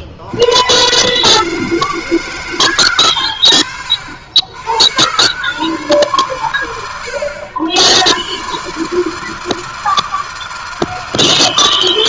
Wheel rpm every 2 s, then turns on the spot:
80, 160, 100, 110, 130, 160.
none